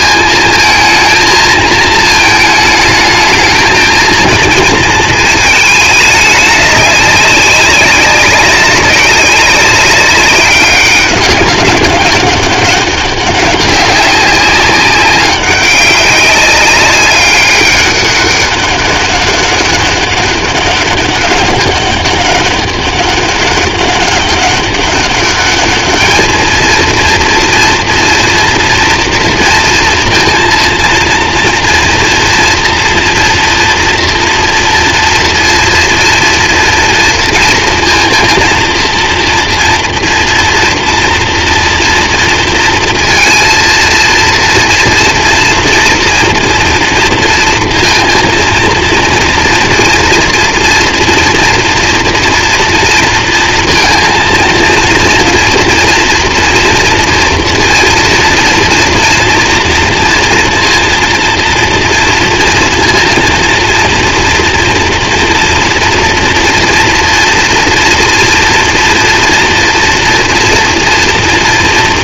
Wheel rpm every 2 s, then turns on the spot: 220, 220, 220, 200, 190, 200, 200, 200, 200, 200, 200, 200, 200, 230, 230, 230, 230, 230, 230, 230, 230, 230, 230, 230, 230, 230, 230, 230, 230, 230, 230, 230, 230, 230, 230, 230.
none